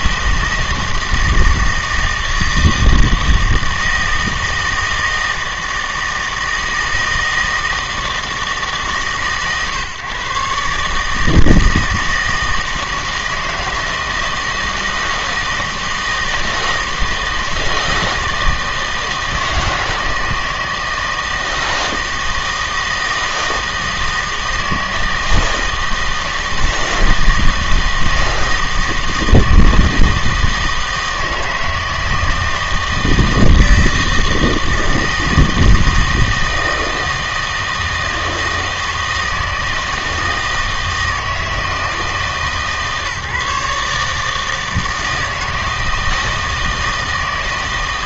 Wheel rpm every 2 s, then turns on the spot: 160, 160, 160, 160, 150, 140, 160, 160, 160, 160, 160, 160, 160, 160, 160, 160, 160, 160, 160, 160, 160, 140, 160, 160.
none